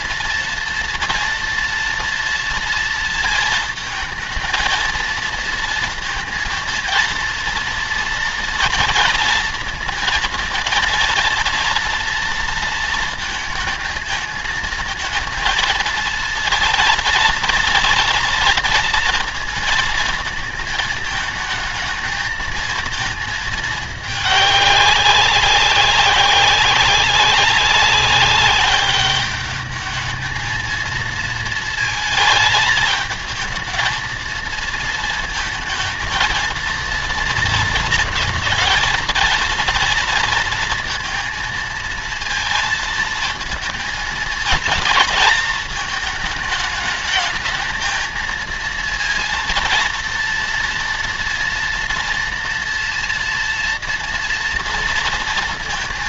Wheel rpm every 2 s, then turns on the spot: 230, 230, 230, 230, 230, 230, 220, 220, 230, 230, 220, 220, 200, 200, 200, 220, 220, 230, 230, 220, 230, 230, 230, 220, 230, 230, 230, 230.
none